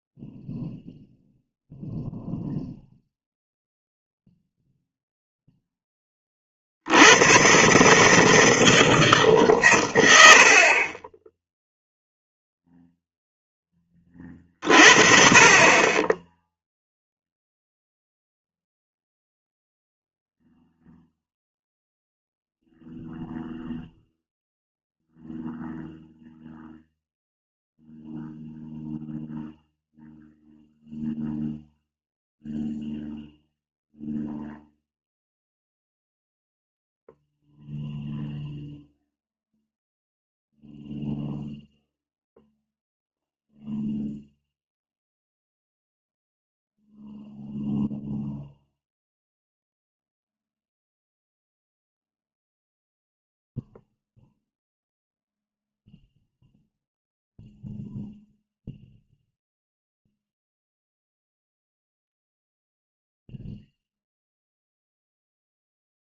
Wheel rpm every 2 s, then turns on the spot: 0, 0, 0, 70, 160, 30, 0, 40, 0, 0, 0, 0, 0, 0, 0, 0, 0, 0, 0, 0, 0, 0, 0, 0, 0, 0, 0, 0, 0, 0, 0, 0, 0.
none